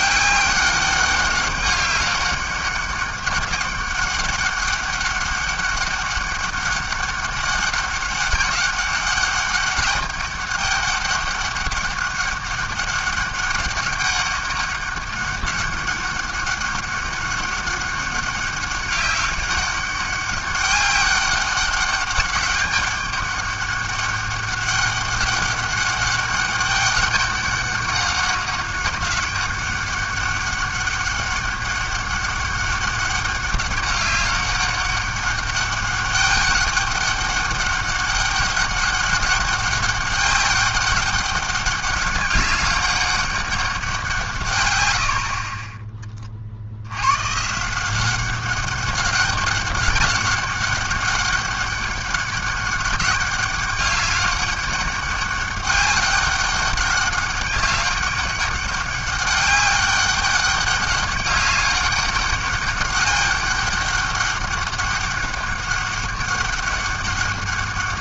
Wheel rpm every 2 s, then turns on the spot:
200, 200, 200, 200, 200, 200, 200, 200, 200, 200, 200, 200, 200, 200, 200, 200, 200, 200, 200, 200, 200, 200, 110, 70, 200, 200, 200, 200, 200, 200, 200, 200, 200, 200.
none